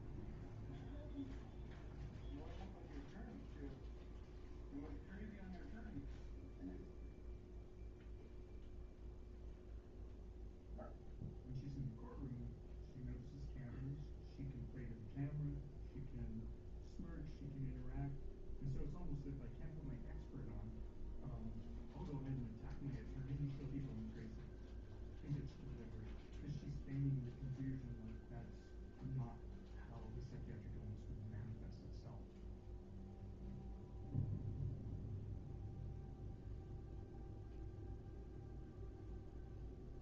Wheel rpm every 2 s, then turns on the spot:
0, 0, 0, 0, 0, 0, 0, 0, 0, 0, 0, 0, 0, 0, 0, 0, 0, 0, 0, 0.
none